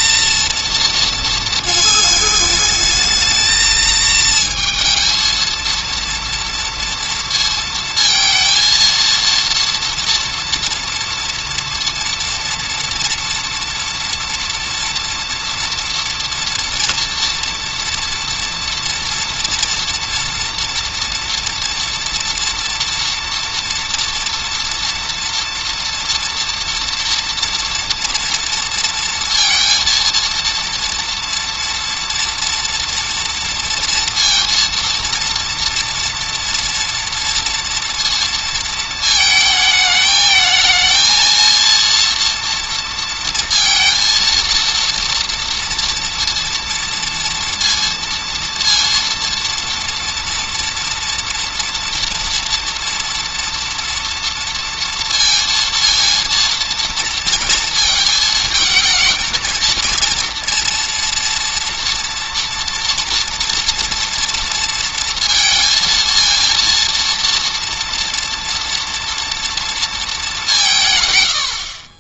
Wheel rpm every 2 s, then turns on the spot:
230, 220, 220, 230, 230, 230, 230, 230, 230, 230, 230, 230, 230, 230, 230, 230, 240, 230, 230, 230, 220, 230, 230, 230, 230, 240, 240, 230, 230, 220, 230, 230, 230, 230, 230, 160.
none